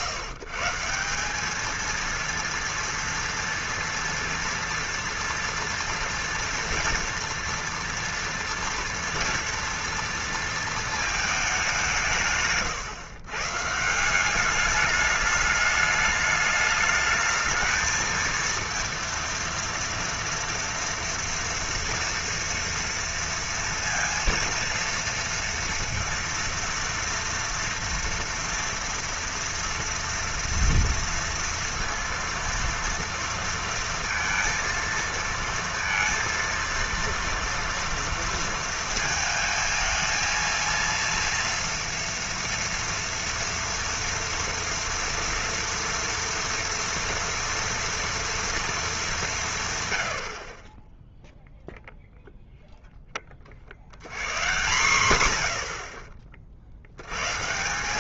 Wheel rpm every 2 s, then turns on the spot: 160, 230, 230, 230, 230, 230, 130, 200, 210, 230, 230, 230, 230, 230, 240, 230, 230, 230, 230, 230, 230, 230, 230, 230, 230, 30, 0, 120, 50.
none